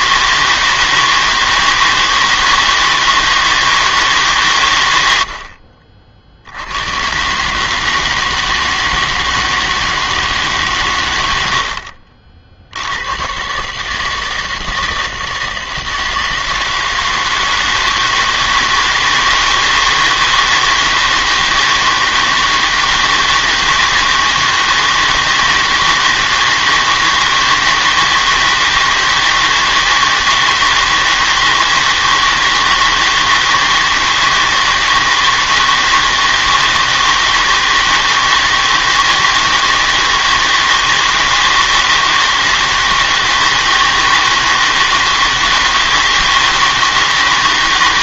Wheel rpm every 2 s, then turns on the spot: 160, 160, 110, 90, 160, 140, 70, 160, 160, 160, 160, 160, 160, 160, 160, 160, 160, 160, 160, 160, 160, 160, 160, 160.
none